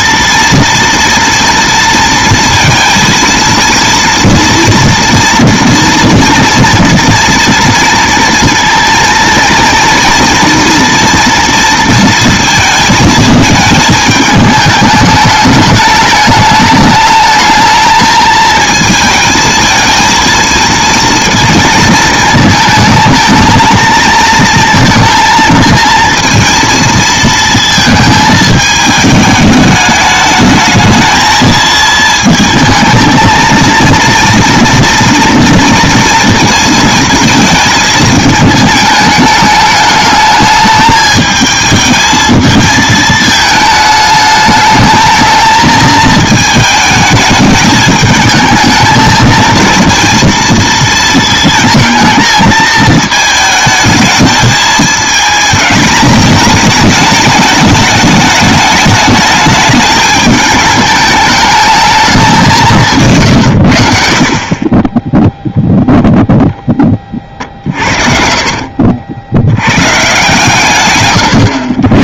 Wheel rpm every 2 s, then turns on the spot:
230, 230, 230, 230, 230, 230, 220, 210, 210, 220, 230, 220, 230, 230, 220, 220, 220, 230, 220, 220, 210, 220, 220, 220, 220, 230, 220, 220, 210, 210, 210, 160, 30, 10, 60, 130.
64-66 68-70